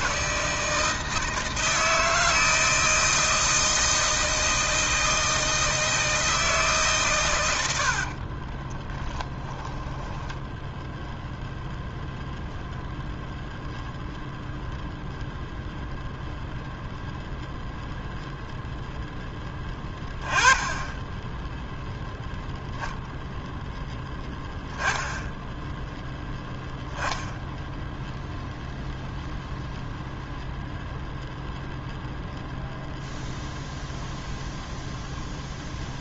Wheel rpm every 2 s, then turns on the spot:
160, 160, 160, 140, 10, 0, 0, 0, 0, 0, 10, 0, 0, 10, 0, 0, 0, 0.
8-10